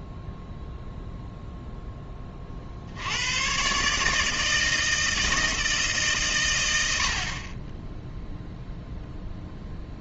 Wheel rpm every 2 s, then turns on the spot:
0, 50, 160, 100, 0.
none